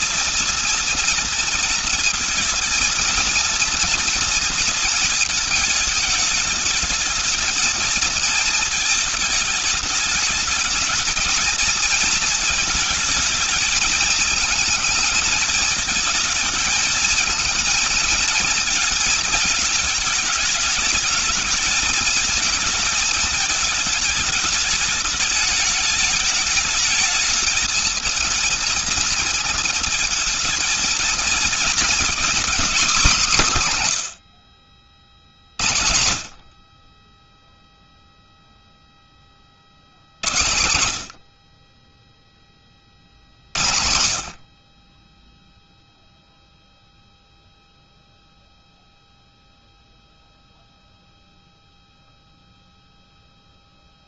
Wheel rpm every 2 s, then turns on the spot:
230, 230, 230, 210, 220, 220, 220, 220, 230, 220, 220, 220, 210, 220, 230, 230, 240, 60, 30, 10, 90, 40, 20, 0, 0, 0, 0.
none